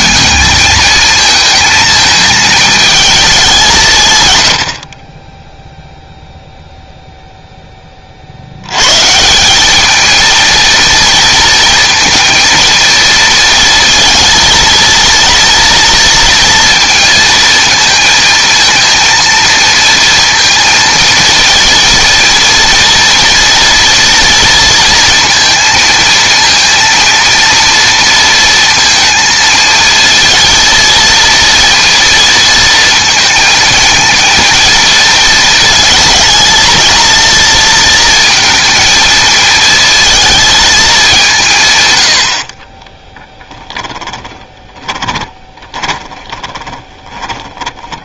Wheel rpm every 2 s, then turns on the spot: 220, 220, 180, 0, 10, 210, 230, 230, 230, 230, 230, 230, 240, 230, 230, 220, 230, 230, 220, 230, 220, 100, 20, 20.
44-48